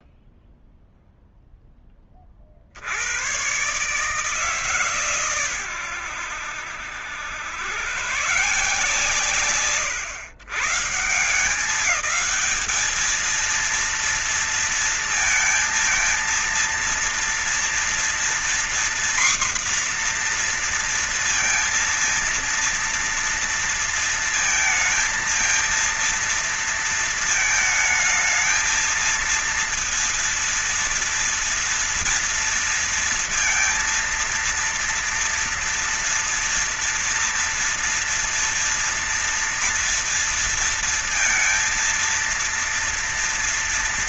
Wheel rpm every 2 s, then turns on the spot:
0, 50, 150, 90, 130, 130, 210, 230, 230, 240, 240, 230, 230, 230, 220, 230, 230, 230, 230, 230, 230, 230.
none